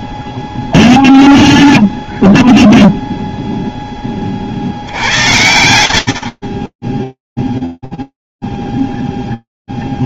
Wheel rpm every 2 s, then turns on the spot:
0, 0, 100, 0, 0.
none